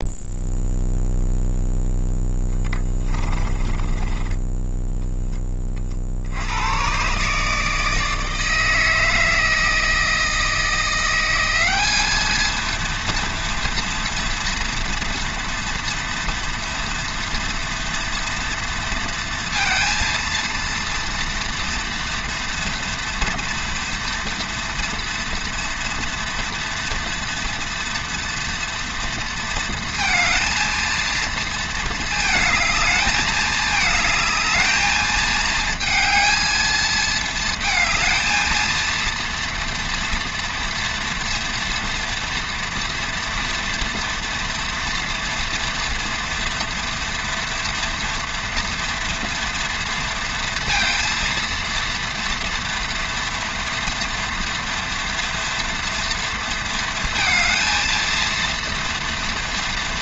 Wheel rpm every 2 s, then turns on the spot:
0, 20, 10, 110, 160, 170, 230, 230, 230, 230, 230, 240, 230, 230, 230, 230, 220, 220, 220, 230, 230, 230, 230, 230, 240, 230, 240, 230, 230, 230.
2-6